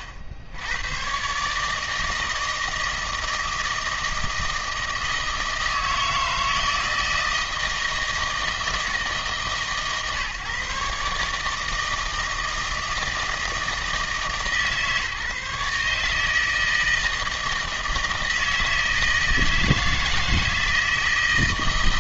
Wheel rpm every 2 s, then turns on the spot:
80, 160, 160, 160, 150, 140, 160, 150, 160, 160, 160.
none